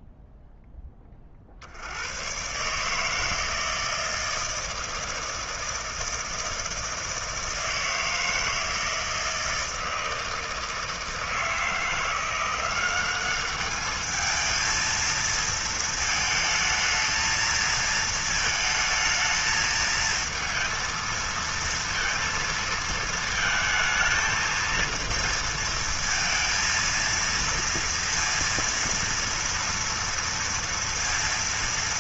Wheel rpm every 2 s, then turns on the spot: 0, 120, 160, 160, 160, 160, 180, 220, 220, 220, 230, 230, 230, 230, 230, 230.
none